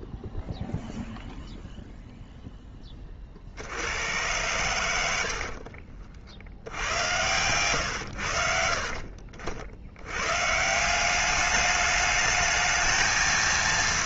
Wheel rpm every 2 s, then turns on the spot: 0, 20, 80, 80, 50, 160, 220.
none